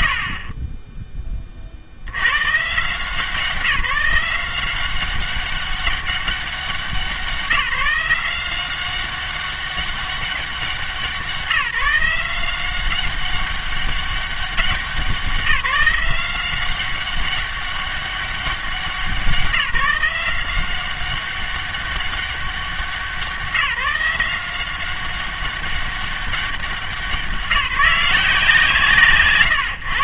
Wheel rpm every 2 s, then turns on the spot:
50, 140, 180, 180, 180, 180, 180, 190, 190, 190, 180, 180, 180, 190, 150.
0-2